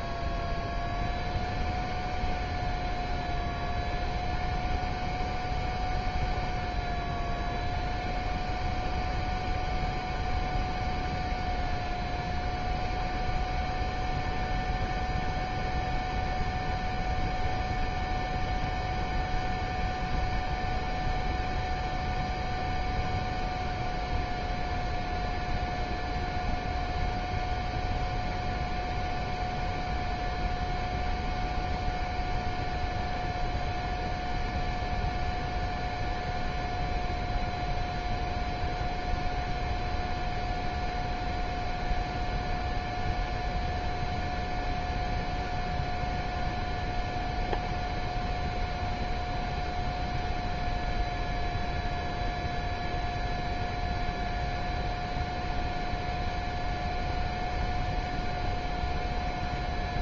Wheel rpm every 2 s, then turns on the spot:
0, 0, 0, 0, 0, 0, 0, 0, 0, 0, 0, 0, 0, 0, 0, 0, 0, 0, 0, 0, 0, 0, 0, 0, 0, 0, 0, 0, 0, 0.
none